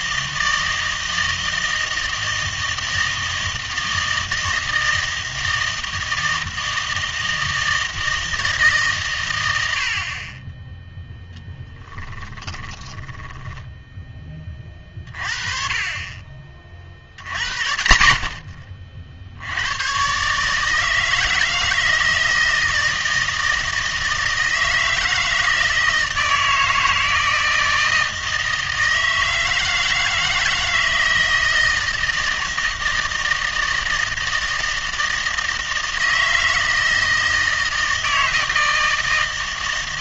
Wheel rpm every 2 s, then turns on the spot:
160, 160, 160, 160, 150, 10, 10, 30, 40, 40, 160, 160, 160, 160, 160, 160, 160, 160, 160, 160.
12-14